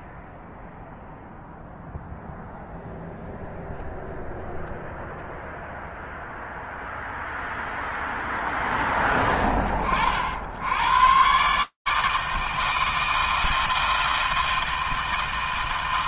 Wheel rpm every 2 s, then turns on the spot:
0, 0, 0, 0, 0, 60, 160, 160.
none